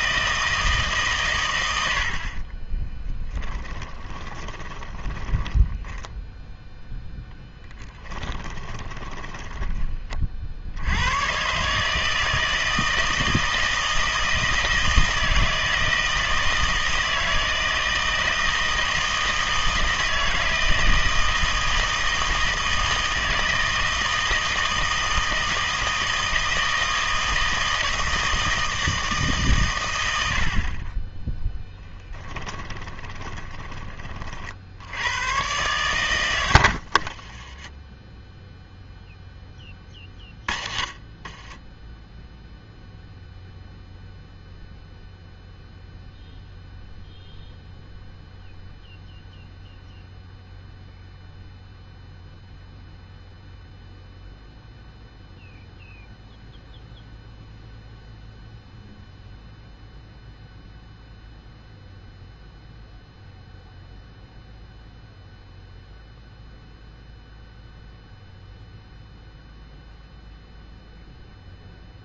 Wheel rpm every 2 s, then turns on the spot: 150, 30, 20, 0, 20, 60, 160, 160, 160, 160, 160, 160, 160, 160, 160, 40, 20, 60, 70, 0, 30, 0, 0, 0, 0, 0, 0, 0, 0, 0, 0, 0, 0, 0, 0, 0.
2-6 8-10 32-34 36-38